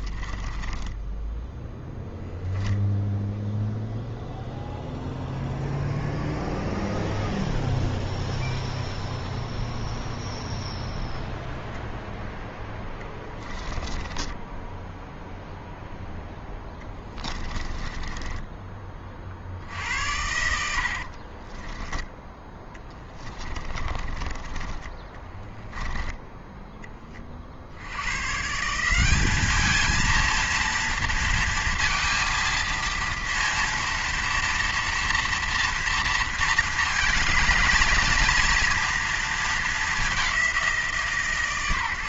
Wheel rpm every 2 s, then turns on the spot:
10, 0, 0, 0, 0, 0, 10, 10, 10, 20, 80, 10, 20, 10, 160, 230, 230, 230, 230, 240, 170.
0-2 12-18 20-24